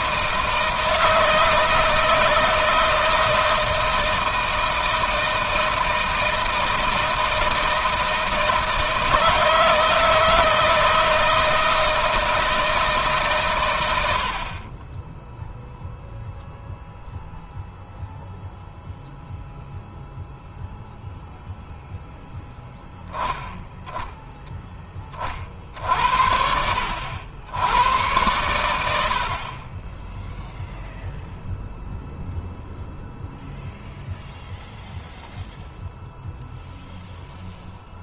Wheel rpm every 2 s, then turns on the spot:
160, 160, 160, 160, 160, 160, 160, 30, 0, 0, 0, 0, 10, 70, 80, 0, 0, 0, 0.
none